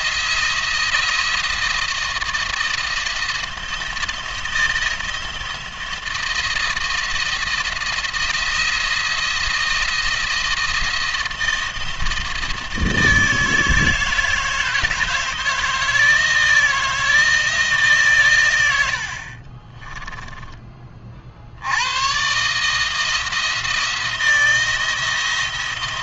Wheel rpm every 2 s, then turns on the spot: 170, 170, 160, 170, 170, 160, 160, 160, 160, 100, 20, 150, 170.
none